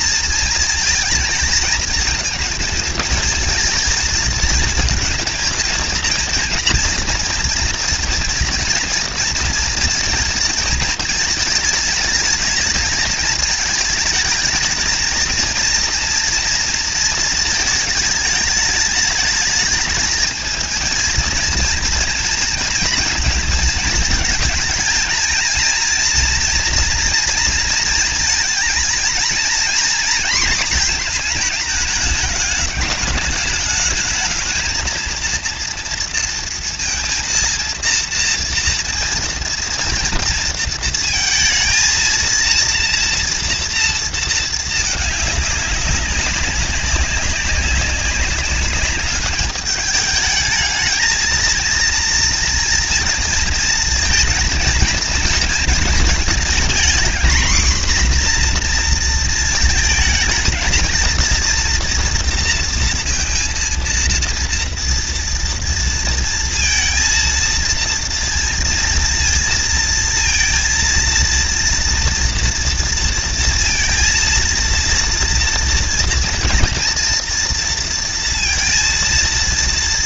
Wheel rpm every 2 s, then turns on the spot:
230, 220, 220, 230, 230, 220, 220, 220, 230, 210, 220, 230, 230, 240, 230, 230, 210, 220, 230, 230, 230, 230, 220, 200, 200, 220, 230, 230, 230, 240, 220, 230, 230, 230, 230, 230, 230, 230, 230, 230.
none